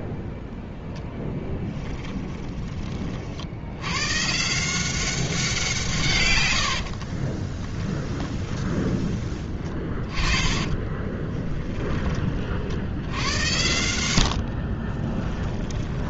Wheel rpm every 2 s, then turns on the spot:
0, 20, 170, 80, 20, 20, 70, 50.
6-8 10-12 14-16